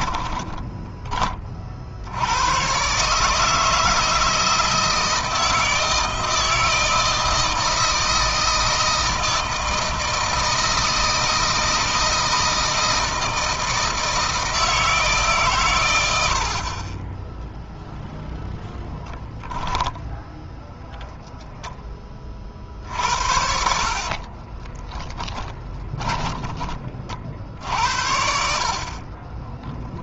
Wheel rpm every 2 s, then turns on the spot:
20, 130, 160, 160, 160, 160, 160, 160, 30, 10, 0, 50, 20, 30, 40.
0-2 24-26 28-30